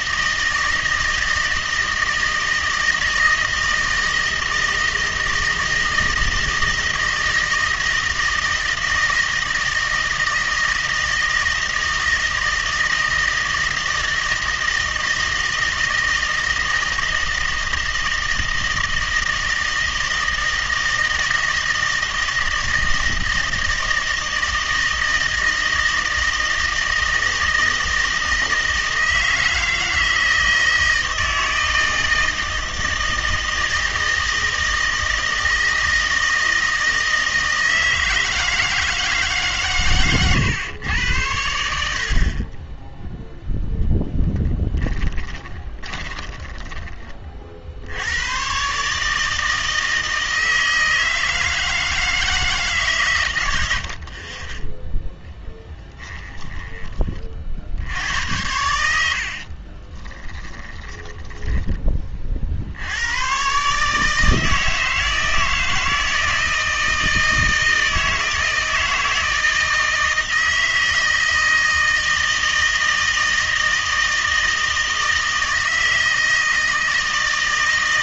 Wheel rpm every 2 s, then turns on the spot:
160, 160, 160, 160, 160, 160, 160, 160, 160, 160, 160, 160, 160, 160, 160, 160, 160, 160, 160, 160, 110, 20, 20, 10, 130, 160, 150, 10, 30, 90, 20, 70, 160, 160, 160, 160, 160, 160, 160.
44-46 56-62